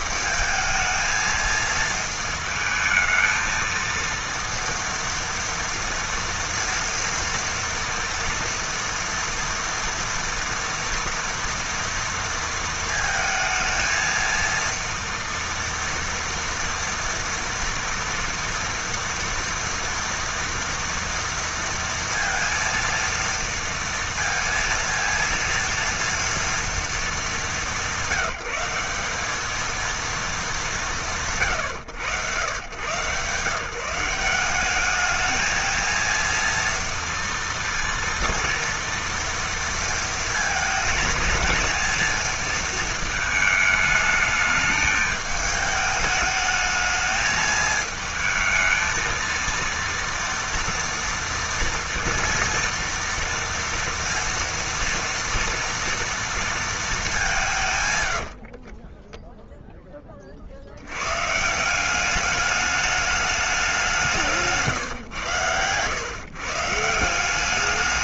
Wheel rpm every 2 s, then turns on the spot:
220, 220, 230, 230, 230, 230, 230, 230, 230, 230, 230, 230, 230, 230, 190, 220, 110, 200, 230, 230, 220, 230, 220, 210, 220, 230, 230, 230, 230, 50, 50, 210, 150, 110.
58-60